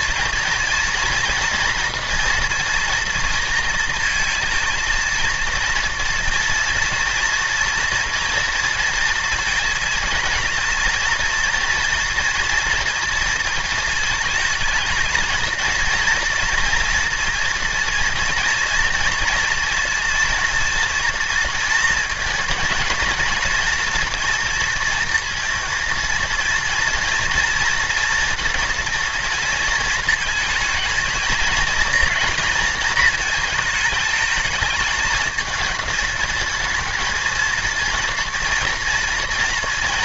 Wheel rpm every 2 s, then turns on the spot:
230, 230, 230, 230, 230, 230, 230, 220, 240, 230, 230, 230, 230, 230, 230, 230, 220, 220, 220, 230.
none